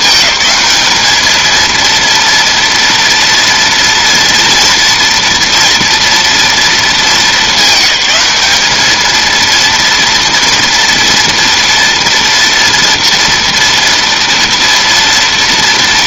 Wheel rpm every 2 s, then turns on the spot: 210, 230, 230, 230, 210, 240, 230, 230.
none